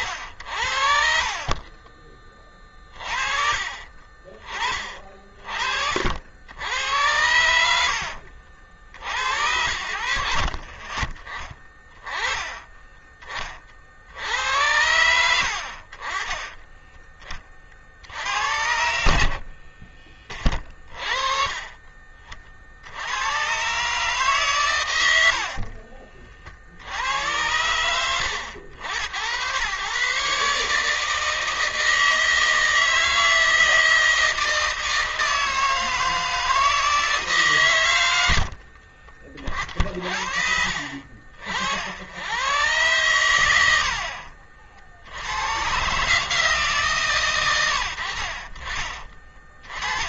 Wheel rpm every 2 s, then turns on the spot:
50, 20, 30, 70, 60, 50, 20, 70, 30, 70, 30, 50, 140, 60, 80, 140, 160, 160, 160, 80, 50, 100, 60, 150, 50.
0-2 16-18